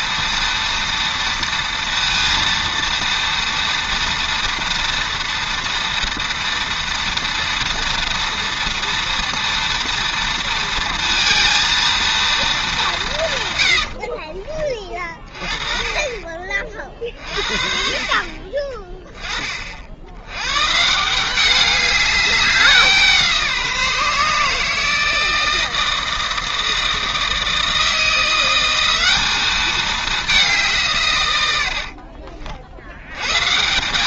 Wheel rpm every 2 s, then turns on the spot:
230, 230, 230, 230, 230, 230, 210, 30, 40, 30, 140, 190, 160, 160, 180, 180, 70.
none